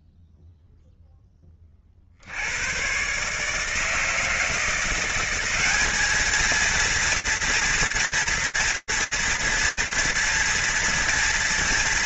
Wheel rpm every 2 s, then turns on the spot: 0, 20, 150, 180, 230, 230.
none